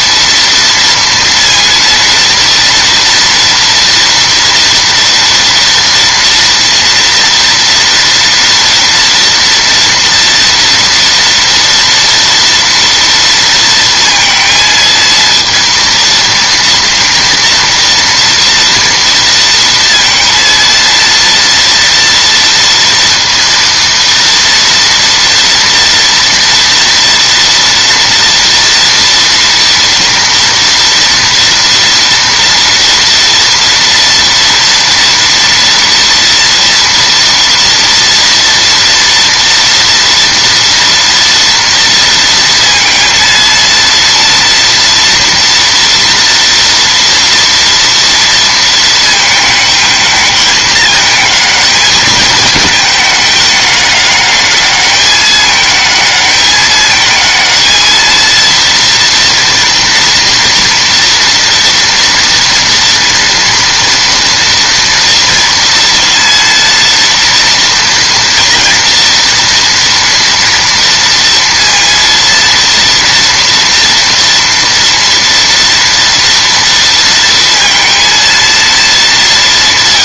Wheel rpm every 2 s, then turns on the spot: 230, 230, 230, 230, 230, 230, 230, 230, 230, 230, 230, 230, 230, 230, 230, 230, 230, 230, 230, 230, 230, 230, 230, 230, 230, 220, 220, 210, 210, 230, 230, 230, 230, 230, 230, 230, 230, 240, 230, 220.
none